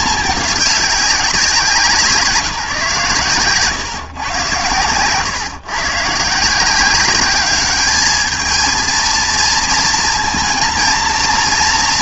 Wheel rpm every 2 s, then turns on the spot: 200, 170, 130, 180, 220, 230.
none